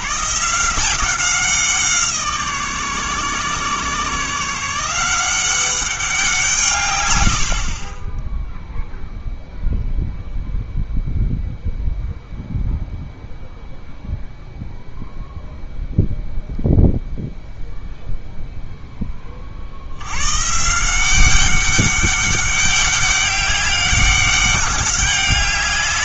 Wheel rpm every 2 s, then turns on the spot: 160, 150, 160, 160, 0, 0, 0, 0, 0, 0, 150, 200, 200.
none